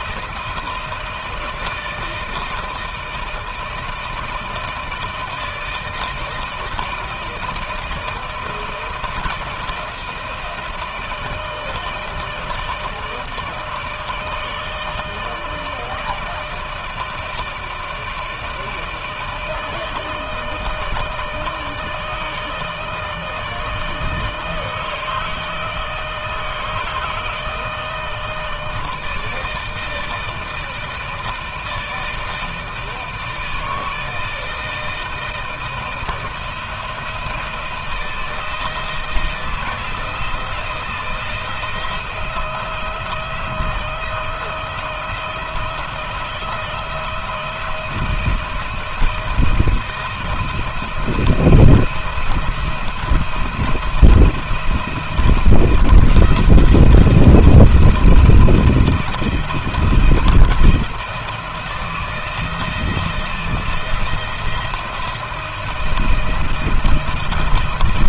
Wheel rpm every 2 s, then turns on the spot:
160, 160, 160, 160, 160, 160, 160, 160, 160, 160, 160, 160, 160, 160, 160, 160, 160, 160, 160, 160, 160, 170, 170, 170, 170, 170, 170, 170, 160, 170, 170, 170, 170, 170.
none